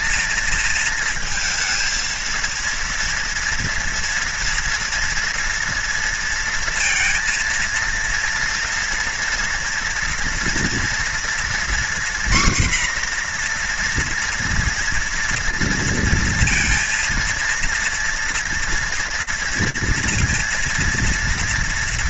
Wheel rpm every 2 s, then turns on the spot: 220, 230, 230, 230, 240, 230, 250, 230, 230, 230, 230.
none